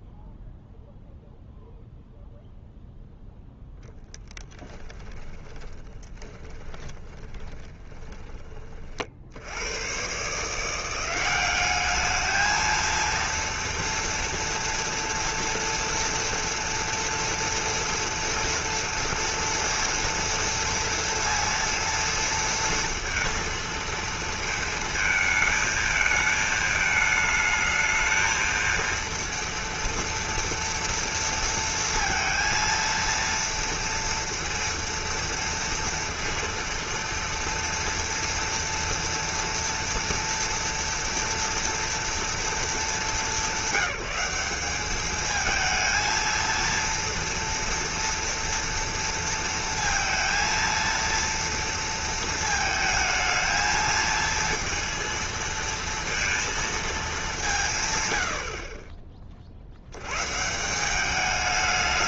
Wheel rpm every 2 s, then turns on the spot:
0, 0, 10, 20, 30, 170, 220, 230, 230, 230, 230, 230, 220, 220, 230, 230, 230, 230, 230, 230, 230, 200, 200, 230, 230, 230, 220, 230, 230, 60, 170.
4-8